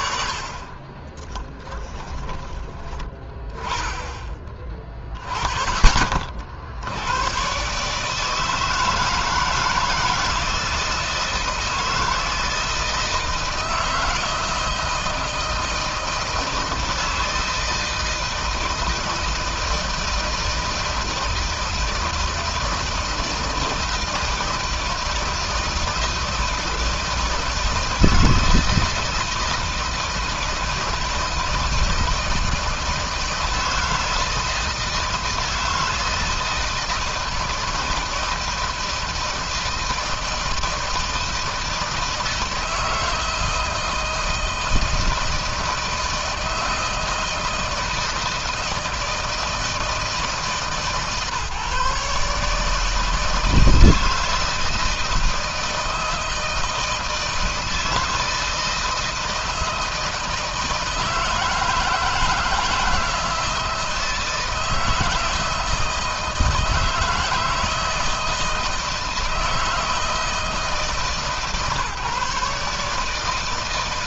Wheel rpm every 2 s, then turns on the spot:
20, 20, 30, 80, 160, 160, 160, 160, 160, 160, 160, 160, 160, 160, 160, 160, 160, 160, 160, 160, 160, 160, 160, 160, 170, 150, 160, 160, 160, 160, 160, 160, 160, 160, 160, 160, 150.
0-2